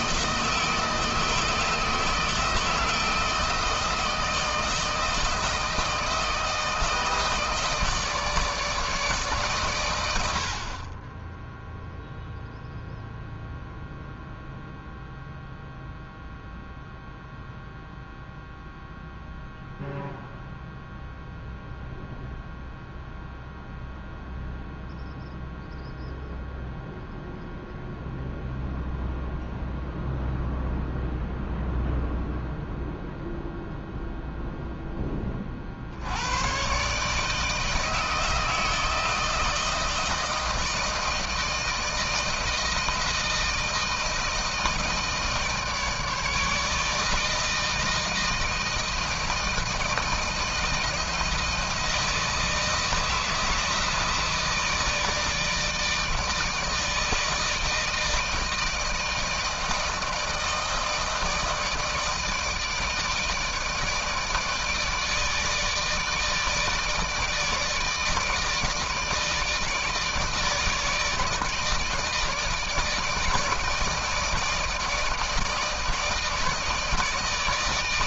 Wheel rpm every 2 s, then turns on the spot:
160, 160, 160, 160, 150, 40, 0, 0, 0, 0, 0, 0, 0, 0, 0, 0, 0, 0, 120, 160, 160, 160, 160, 160, 160, 160, 160, 160, 160, 160, 160, 160, 160, 150, 160, 160, 160, 160, 160.
none